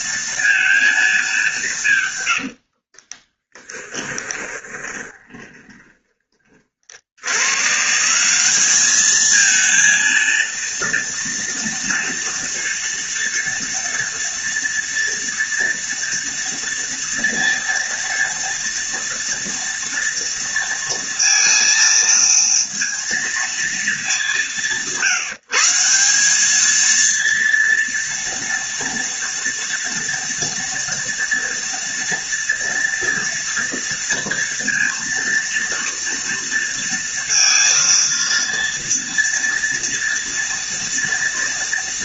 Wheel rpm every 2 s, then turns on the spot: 220, 40, 20, 60, 210, 230, 230, 230, 230, 230, 230, 230, 160, 230, 230, 230, 230, 230, 230, 230, 230.
2-6